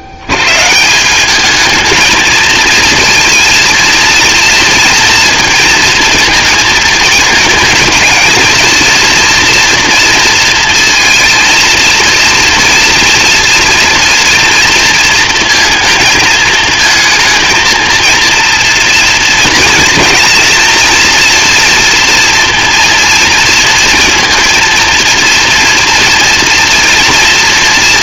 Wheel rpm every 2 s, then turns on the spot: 140, 230, 230, 230, 230, 230, 230, 230, 230, 230, 230, 230, 230, 230.
none